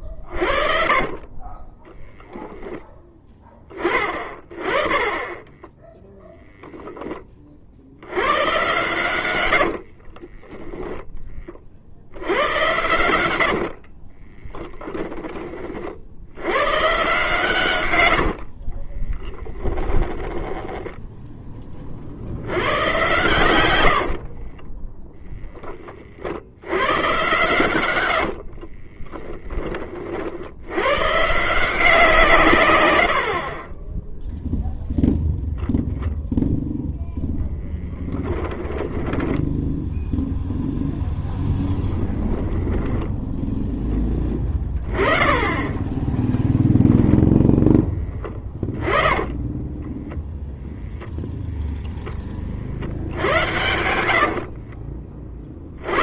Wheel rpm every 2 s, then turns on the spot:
0, 30, 0, 90, 30, 70, 30, 50, 100, 20, 30, 80, 20, 110, 30, 170, 30, 0, 10, 10, 0, 0, 20, 0, 10, 0, 80, 50.
8-10 12-14 18-20 22-24 26-28 36-40 48-50 52-54